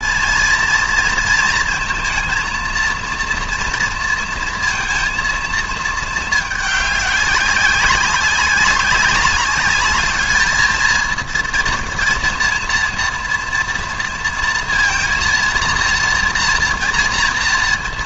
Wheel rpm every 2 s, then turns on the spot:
230, 230, 230, 210, 190, 220, 230, 230, 230.
none